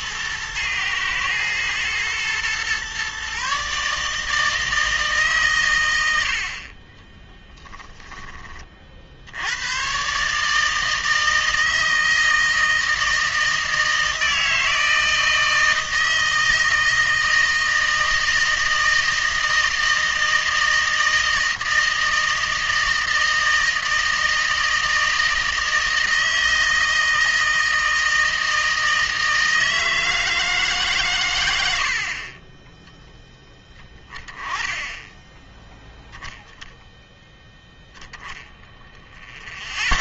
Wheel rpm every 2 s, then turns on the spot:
110, 130, 160, 30, 40, 160, 160, 160, 160, 160, 160, 160, 160, 160, 160, 150, 10, 10, 10, 20.
none